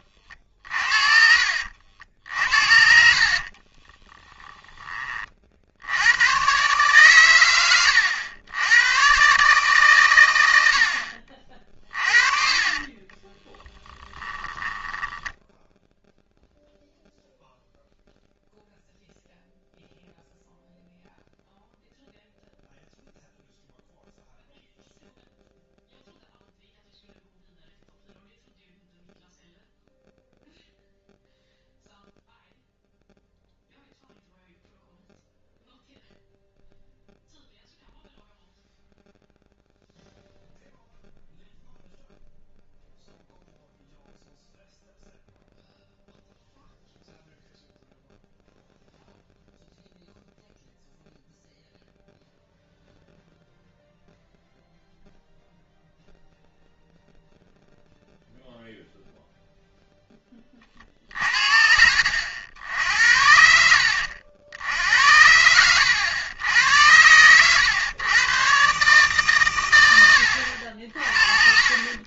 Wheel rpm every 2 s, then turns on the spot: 40, 60, 10, 130, 100, 70, 30, 10, 0, 0, 0, 0, 0, 0, 0, 0, 0, 0, 0, 0, 0, 0, 0, 0, 0, 0, 0, 0, 0, 0, 40, 70, 80, 90, 140, 60.
2-4 12-16